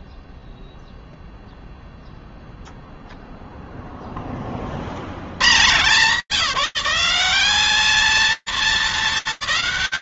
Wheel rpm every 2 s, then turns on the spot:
0, 70, 170, 220, 210.
none